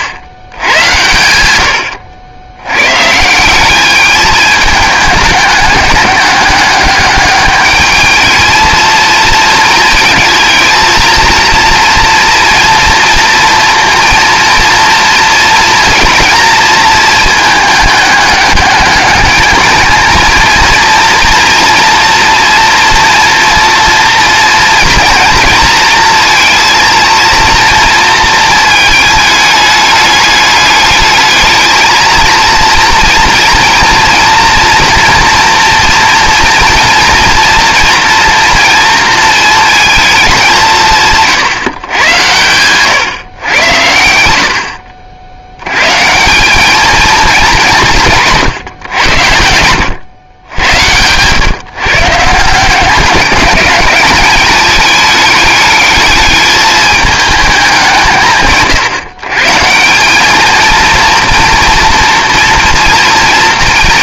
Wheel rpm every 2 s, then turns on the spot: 100, 120, 210, 200, 220, 230, 230, 230, 230, 210, 230, 240, 230, 230, 220, 210, 230, 230, 230, 230, 180, 120, 60, 210, 120, 100, 170, 210, 210, 140, 230, 230.
none